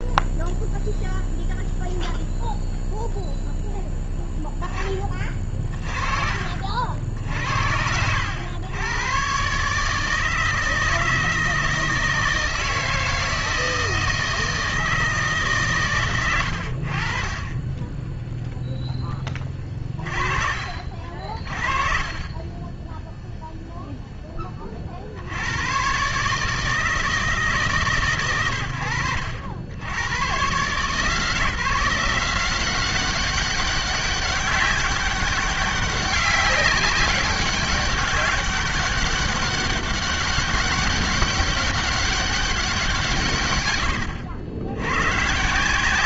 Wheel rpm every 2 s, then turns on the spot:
0, 0, 0, 60, 100, 160, 160, 160, 80, 0, 50, 20, 20, 150, 100, 120, 180, 200, 190, 200, 200, 180, 90.
none